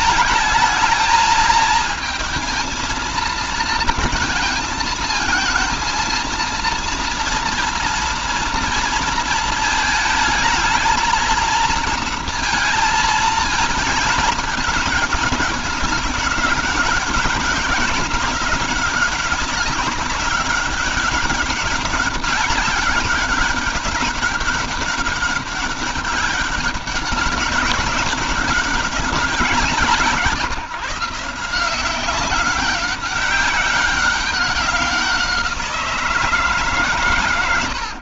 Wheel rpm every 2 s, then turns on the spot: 210, 220, 220, 230, 230, 220, 220, 210, 200, 200, 200, 200, 200, 200, 200, 160, 190, 190, 150.
none